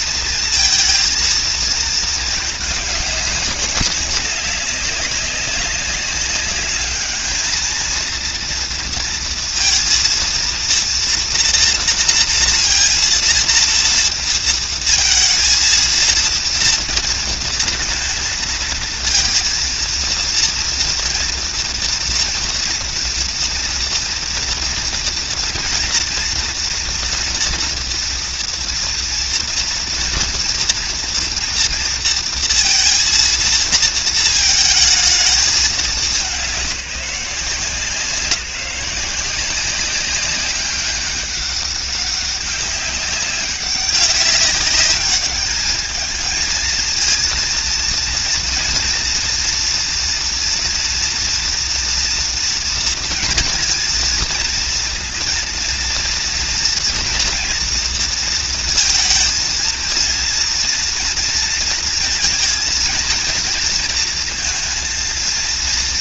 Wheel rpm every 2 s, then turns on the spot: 230, 210, 200, 210, 230, 230, 230, 230, 230, 230, 240, 230, 230, 230, 230, 230, 230, 220, 190, 180, 190, 200, 200, 230, 230, 230, 230, 230, 230, 230, 230, 230, 230.
none